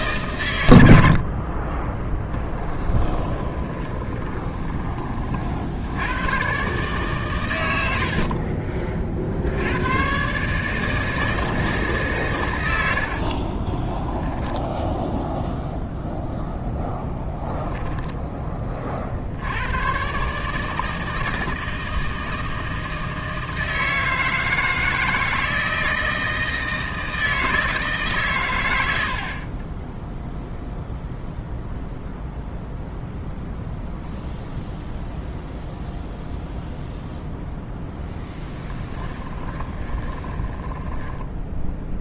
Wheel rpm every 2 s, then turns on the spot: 80, 20, 20, 130, 40, 150, 90, 0, 0, 30, 150, 160, 160, 160, 90, 0, 0, 0, 0, 10, 10.
2-4 38-42